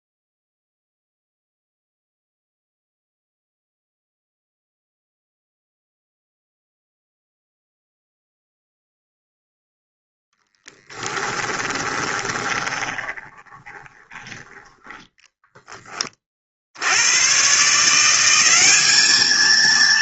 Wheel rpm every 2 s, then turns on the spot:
0, 0, 0, 0, 0, 10, 20, 10, 50, 200.
10-14